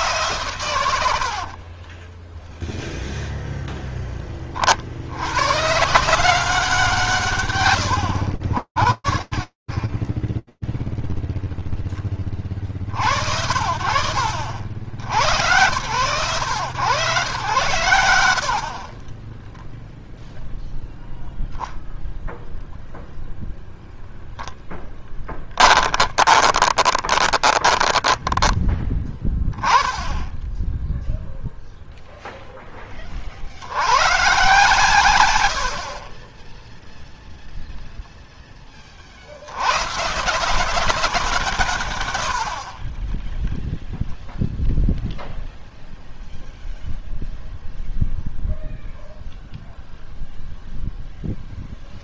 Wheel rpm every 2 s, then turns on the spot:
150, 30, 20, 160, 80, 10, 40, 70, 120, 20, 0, 0, 10, 20, 20, 0, 10, 120, 0, 20, 190, 40, 0, 0, 0, 0.
2-4 18-20 24-28 42-44